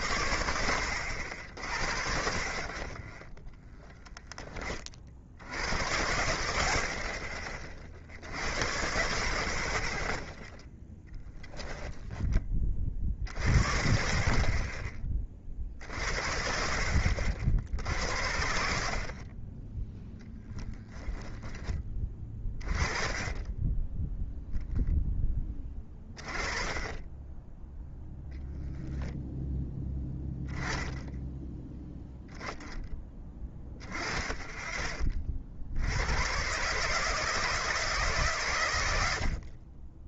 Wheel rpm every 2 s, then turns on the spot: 60, 20, 40, 40, 60, 10, 40, 20, 70, 60, 0, 20, 0, 20, 0, 10, 10, 20, 140, 90.
10-12